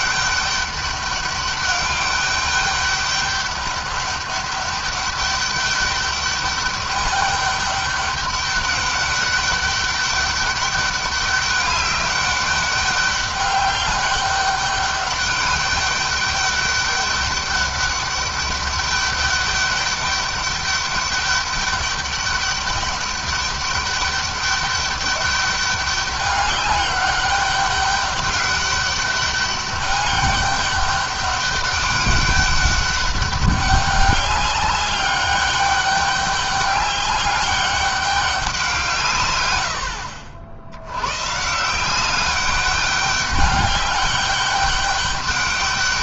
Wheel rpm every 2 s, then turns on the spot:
200, 200, 200, 200, 200, 200, 200, 200, 200, 200, 200, 200, 200, 200, 200, 200, 200, 200, 200, 170, 100, 200, 200.
none